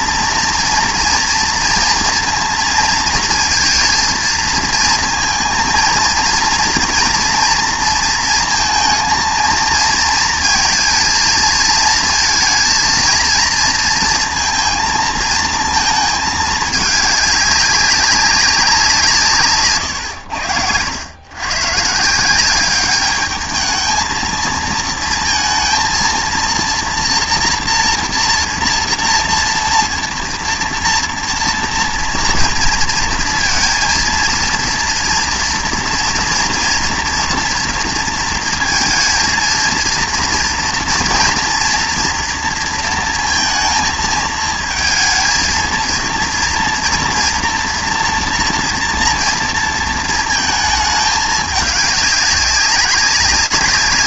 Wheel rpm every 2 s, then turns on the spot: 230, 230, 230, 230, 220, 220, 230, 230, 210, 190, 90, 190, 220, 230, 230, 230, 230, 230, 230, 230, 230, 230, 220, 230, 230, 220, 200.
none